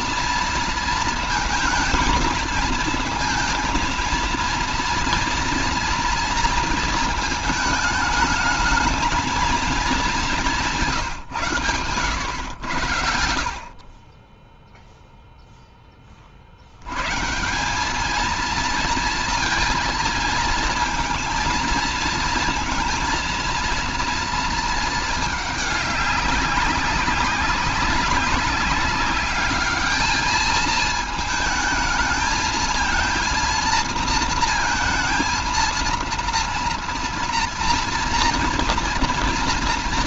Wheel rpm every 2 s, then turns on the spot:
230, 220, 230, 220, 220, 180, 90, 0, 50, 230, 230, 230, 230, 200, 200, 220, 230, 230, 230, 230.
none